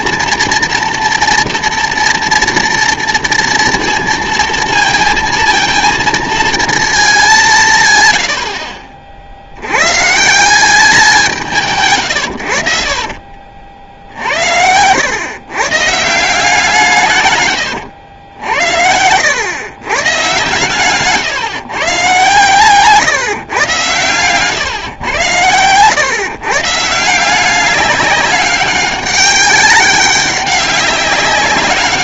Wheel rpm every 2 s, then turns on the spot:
230, 230, 230, 220, 60, 180, 60, 80, 180, 80, 130, 140, 130, 140, 190, 190.
8-10